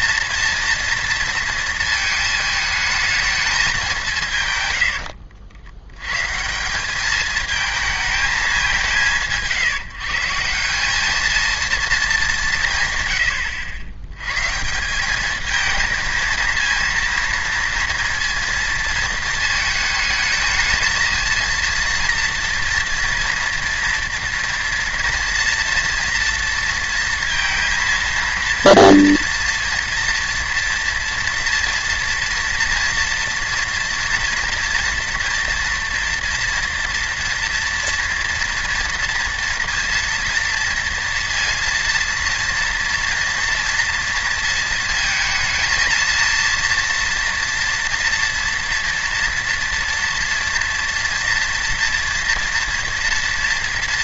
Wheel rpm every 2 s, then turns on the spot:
230, 220, 140, 160, 180, 170, 160, 150, 230, 230, 220, 230, 230, 230, 230, 230, 230, 230, 230, 230, 230, 230, 230, 230, 230, 230, 230.
none